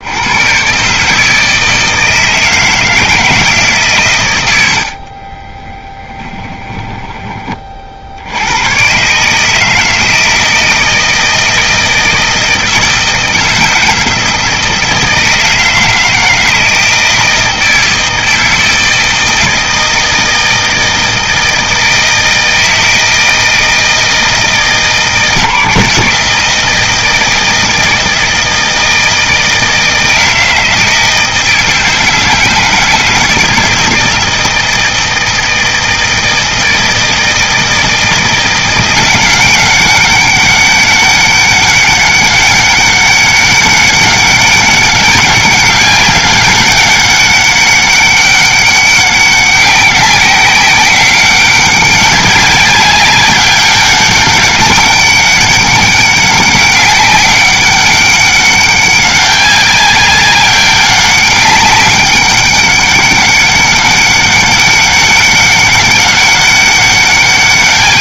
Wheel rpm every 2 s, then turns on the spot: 140, 160, 80, 10, 120, 160, 160, 160, 160, 160, 160, 160, 160, 160, 160, 160, 160, 160, 160, 180, 200, 200, 200, 200, 190, 190, 200, 200, 190, 200, 200, 200, 200, 200.
4-8